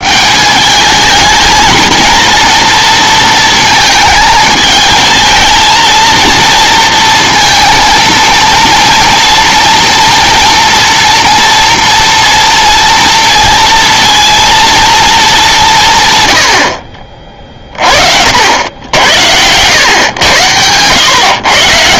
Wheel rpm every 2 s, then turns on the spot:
200, 230, 220, 230, 230, 230, 230, 230, 60, 90, 90.
none